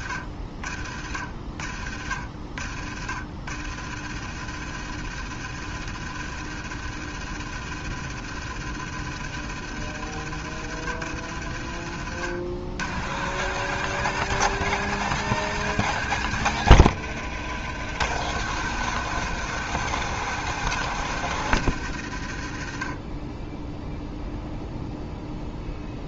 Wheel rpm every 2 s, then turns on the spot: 40, 60, 80, 80, 80, 80, 90, 140, 110, 130, 130, 40, 0.
none